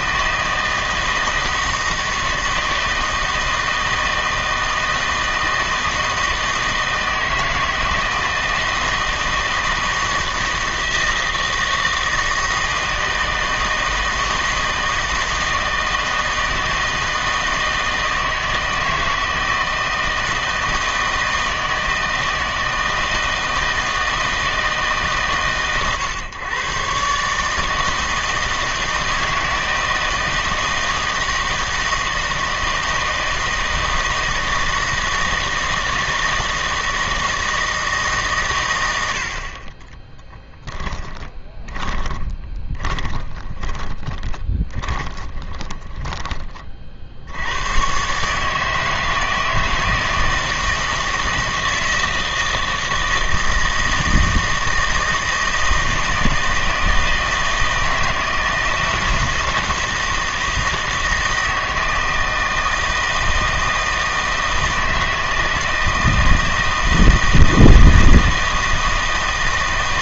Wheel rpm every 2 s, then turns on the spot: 160, 160, 160, 160, 160, 160, 160, 160, 160, 160, 160, 160, 160, 130, 160, 160, 160, 160, 160, 100, 10, 20, 20, 40, 150, 160, 160, 160, 160, 160, 160, 160, 160, 160, 160.
40-46